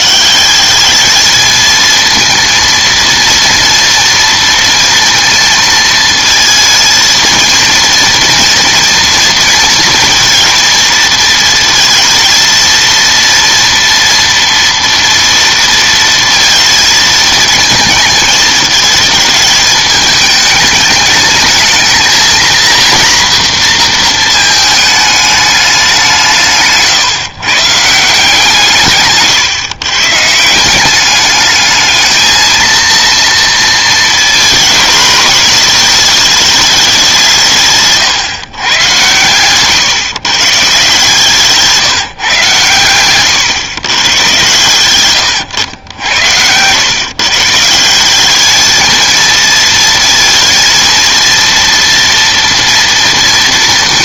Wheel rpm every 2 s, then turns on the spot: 200, 230, 230, 230, 230, 230, 230, 230, 220, 220, 220, 240, 220, 170, 160, 180, 230, 220, 210, 120, 140, 130, 100, 110, 220, 230, 230.
none